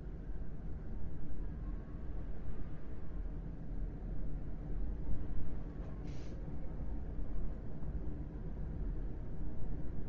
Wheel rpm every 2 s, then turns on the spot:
0, 0, 0, 0, 0.
none